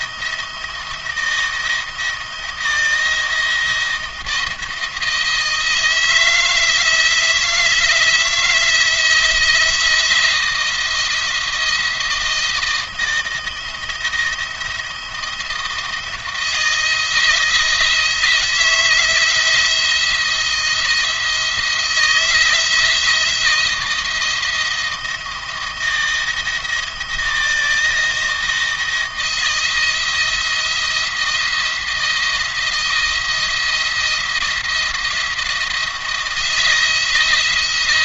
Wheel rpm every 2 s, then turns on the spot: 170, 170, 160, 160, 170, 170, 170, 170, 160, 160, 170, 160, 170, 160, 160, 170, 170, 170, 170.
none